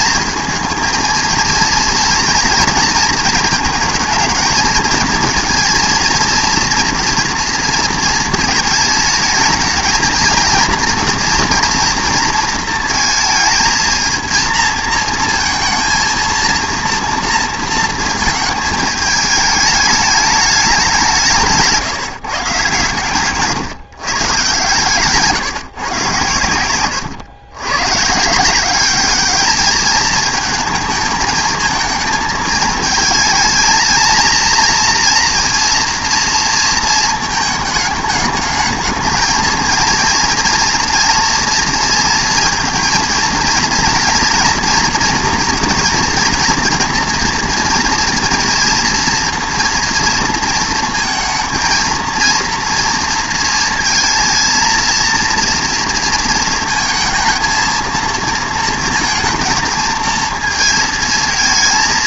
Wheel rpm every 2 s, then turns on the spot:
220, 220, 220, 230, 220, 230, 230, 230, 230, 220, 200, 140, 130, 100, 190, 220, 220, 230, 230, 210, 230, 230, 230, 230, 230, 230, 230, 230, 220, 230, 230.
26-28